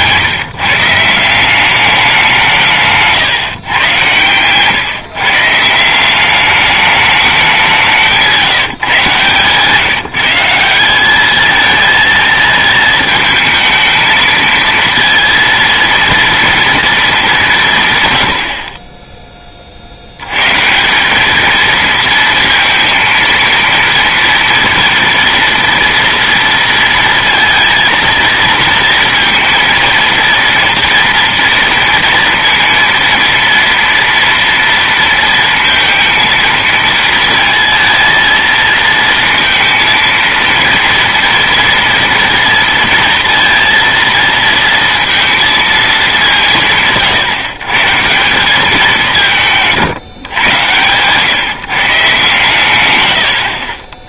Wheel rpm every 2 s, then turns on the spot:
150, 150, 140, 210, 150, 180, 220, 230, 230, 50, 150, 230, 240, 230, 230, 230, 230, 230, 230, 230, 230, 230, 230, 160, 190, 120, 120.
8-10 50-52